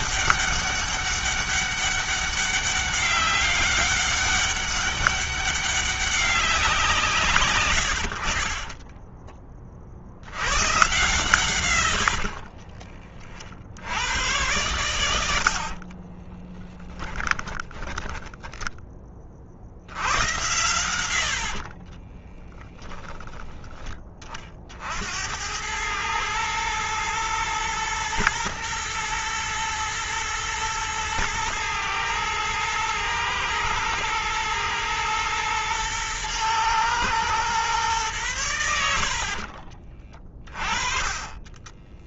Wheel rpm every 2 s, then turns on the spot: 200, 200, 200, 180, 30, 130, 40, 100, 10, 10, 80, 20, 60, 120, 110, 110, 110, 120, 120, 80, 20.
8-10 14-18 20-22